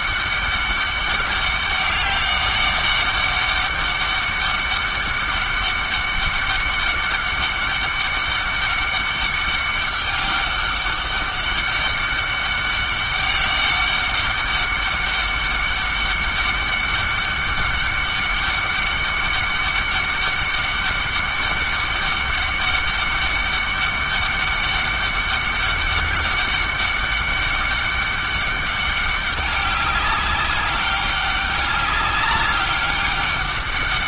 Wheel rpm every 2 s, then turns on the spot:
200, 200, 200, 200, 190, 200, 200, 200, 200, 200, 200, 200, 200, 200, 200, 200, 200.
none